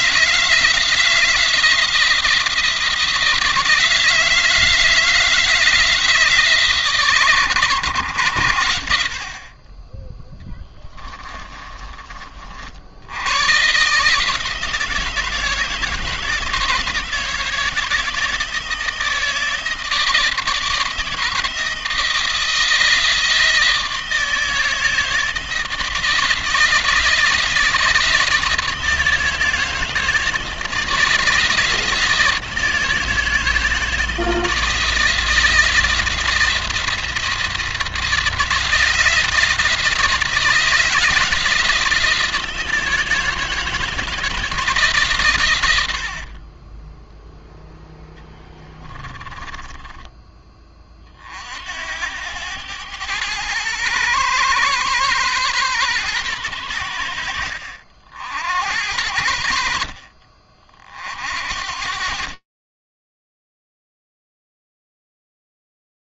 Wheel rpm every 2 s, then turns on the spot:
160, 170, 160, 140, 70, 20, 80, 160, 160, 160, 160, 160, 160, 160, 160, 160, 160, 160, 170, 170, 160, 160, 140, 20, 20, 40, 110, 130, 90, 70, 50, 20, 0.
10-12 46-48 62-64